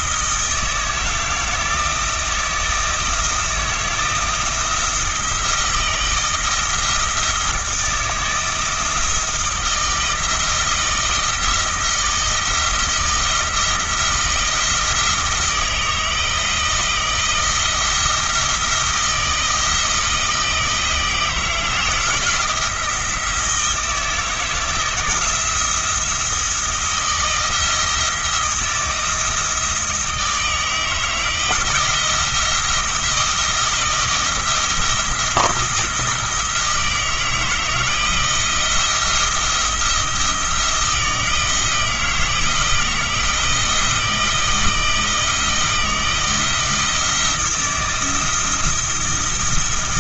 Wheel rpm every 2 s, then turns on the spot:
160, 160, 160, 160, 170, 160, 170, 170, 160, 170, 160, 170, 160, 170, 170, 160, 170, 170, 160, 170, 170, 160, 160, 160, 170.
none